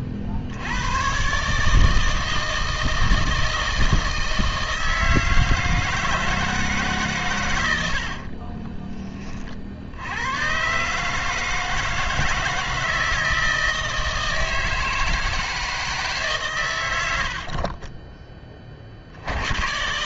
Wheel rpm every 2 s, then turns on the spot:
60, 160, 160, 160, 30, 130, 160, 160, 130, 50.
8-10